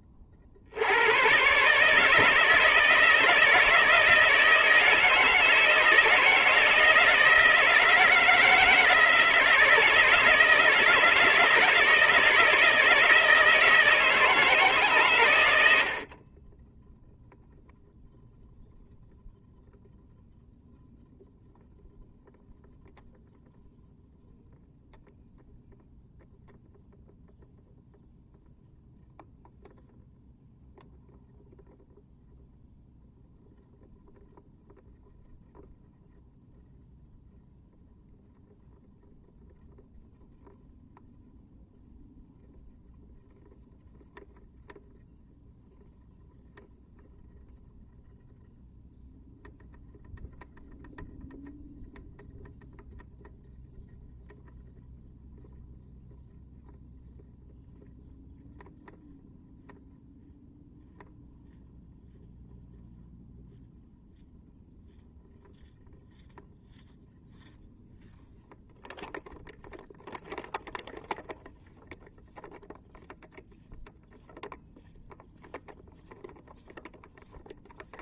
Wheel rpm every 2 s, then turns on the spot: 40, 160, 160, 160, 160, 160, 160, 160, 20, 0, 0, 0, 0, 0, 0, 0, 0, 0, 0, 0, 0, 0, 0, 0, 0, 0, 0, 0, 0, 0, 0, 0, 0, 0, 0, 0, 0, 0, 0.
none